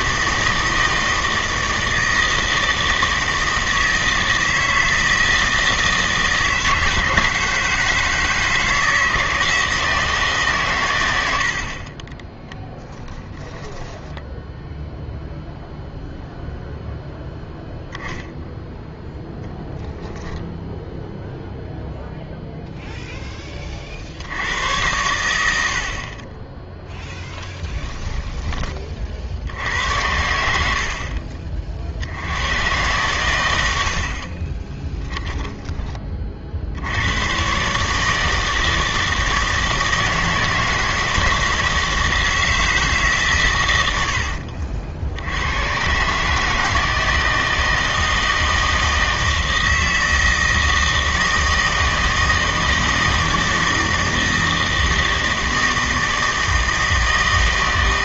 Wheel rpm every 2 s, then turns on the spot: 160, 160, 160, 160, 160, 130, 20, 0, 0, 0, 0, 0, 100, 10, 20, 70, 110, 20, 70, 160, 160, 150, 60, 160, 160, 160, 160, 160, 160.
12-14 30-32 34-36